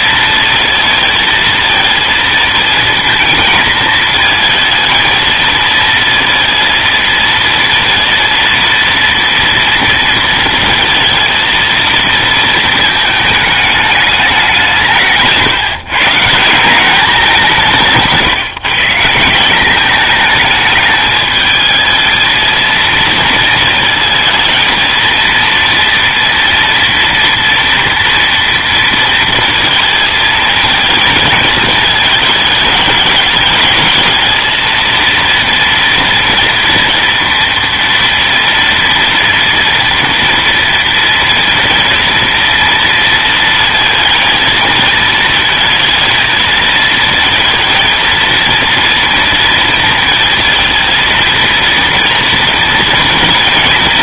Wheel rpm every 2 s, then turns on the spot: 230, 230, 220, 230, 230, 220, 220, 130, 190, 170, 220, 230, 230, 230, 230, 220, 210, 230, 230, 230, 230, 230, 230, 220, 230, 230, 230.
none